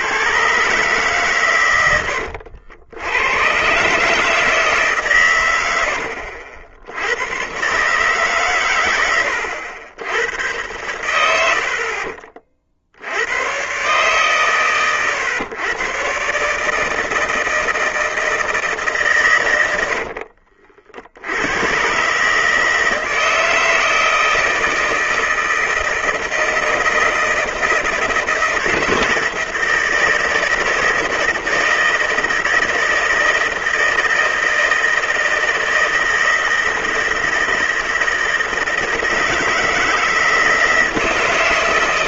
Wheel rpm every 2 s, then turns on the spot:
130, 90, 130, 90, 100, 100, 70, 120, 160, 140, 70, 160, 160, 160, 160, 160, 160, 160, 160, 160, 160.
none